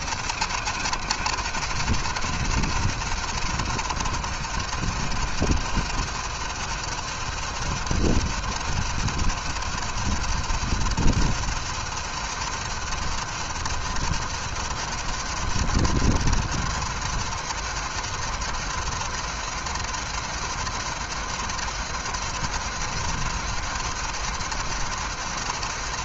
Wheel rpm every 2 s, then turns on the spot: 150, 150, 160, 150, 150, 150, 150, 160, 160, 160, 160, 160, 160.
none